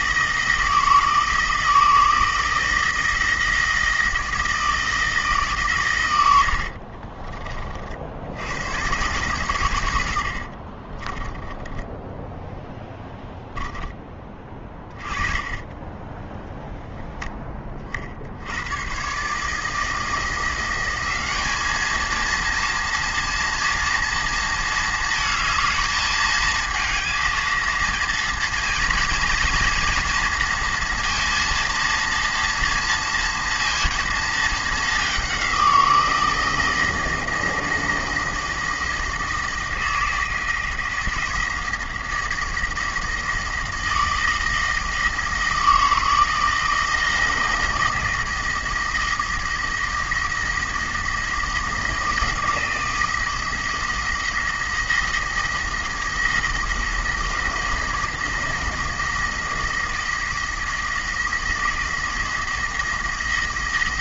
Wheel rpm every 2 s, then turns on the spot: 160, 160, 160, 60, 110, 40, 0, 30, 0, 100, 180, 230, 220, 220, 230, 230, 230, 210, 170, 160, 160, 170, 160, 160, 170, 160, 160, 160, 170, 170, 160, 160.
6-8 10-12 14-16